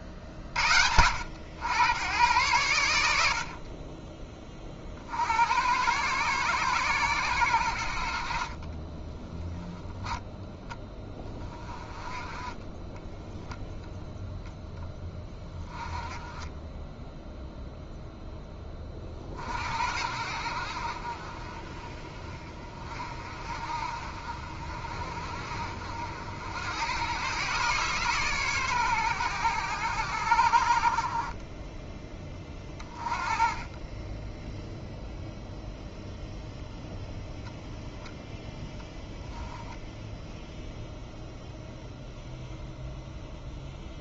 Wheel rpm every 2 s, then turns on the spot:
60, 90, 40, 120, 40, 20, 10, 10, 10, 20, 60, 30, 40, 90, 120, 50, 20, 0, 0, 0, 0, 0.
8-10 12-14